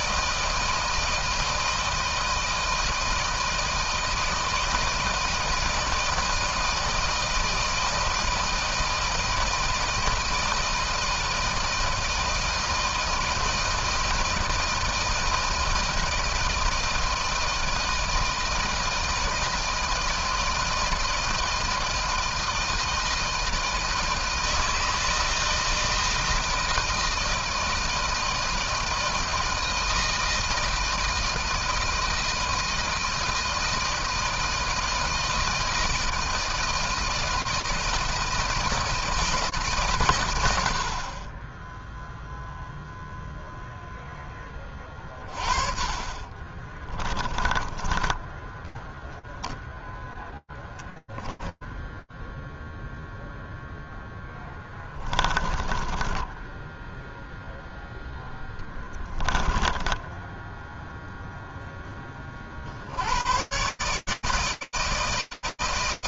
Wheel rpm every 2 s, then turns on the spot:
160, 160, 160, 160, 160, 160, 160, 160, 160, 160, 160, 160, 160, 160, 160, 160, 160, 160, 160, 170, 110, 0, 10, 20, 10, 10, 0, 10, 0, 10, 0, 120, 160.
46-52 54-56 58-60